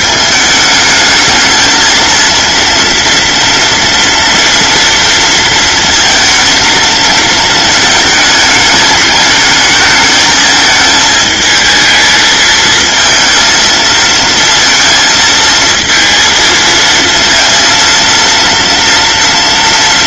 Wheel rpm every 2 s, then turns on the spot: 220, 230, 230, 230, 220, 220, 220, 230, 230, 230.
none